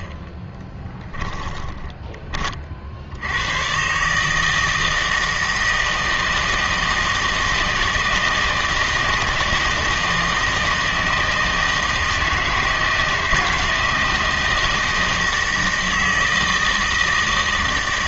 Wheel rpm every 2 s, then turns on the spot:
10, 40, 160, 160, 160, 160, 160, 160, 160.
0-2